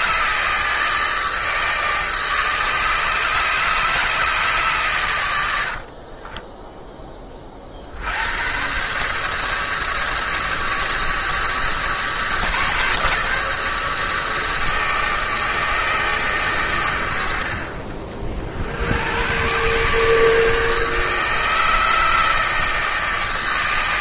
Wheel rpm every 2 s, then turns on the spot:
150, 150, 140, 20, 120, 150, 150, 160, 130, 70, 150, 160.
6-8